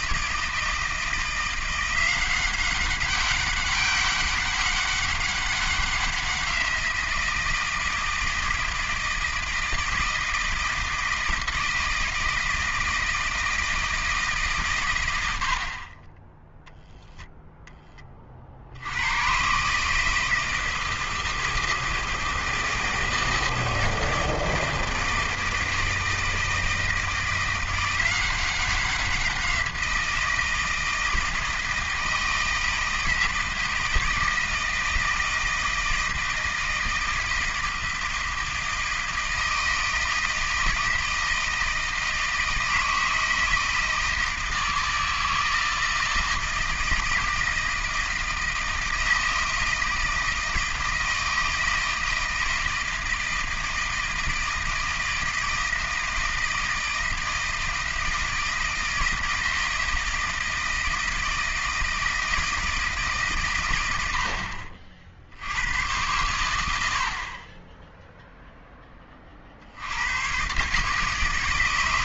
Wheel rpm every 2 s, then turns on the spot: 160, 190, 200, 170, 160, 160, 160, 130, 0, 80, 160, 160, 160, 160, 190, 170, 160, 160, 160, 160, 160, 160, 160, 160, 160, 160, 160, 160, 160, 160, 160, 160, 60, 80, 10, 140.
none